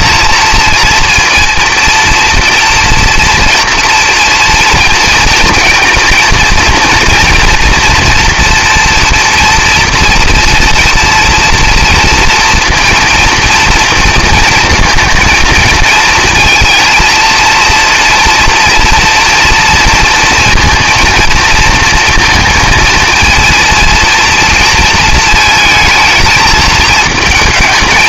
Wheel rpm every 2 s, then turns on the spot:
230, 230, 230, 230, 230, 230, 230, 230, 230, 230, 230, 220, 230, 220.
none